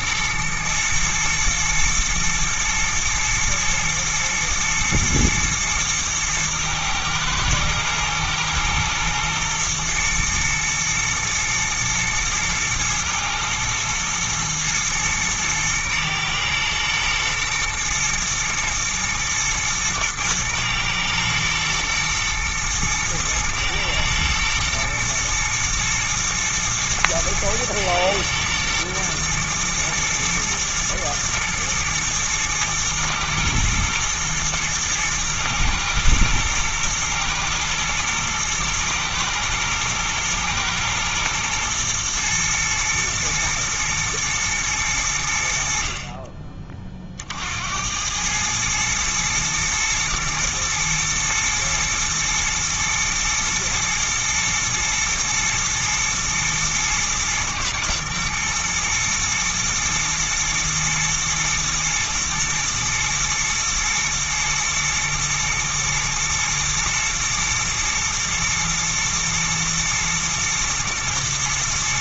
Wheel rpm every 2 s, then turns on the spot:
110, 110, 120, 110, 120, 110, 110, 110, 120, 110, 110, 110, 110, 120, 120, 120, 120, 110, 110, 120, 110, 120, 90, 30, 110, 120, 110, 110, 120, 110, 110, 120, 120, 110, 110, 120.
none